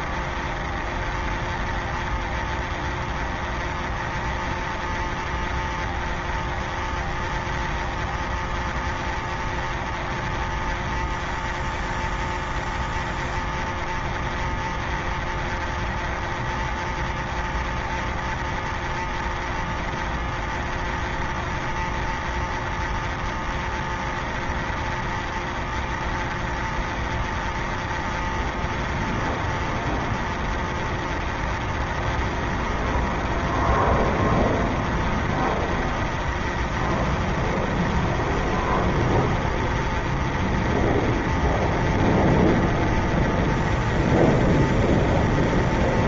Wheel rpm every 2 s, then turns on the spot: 0, 0, 0, 0, 0, 0, 0, 0, 0, 0, 0, 0, 0, 0, 0, 0, 0, 0, 0, 0, 0, 0, 0.
none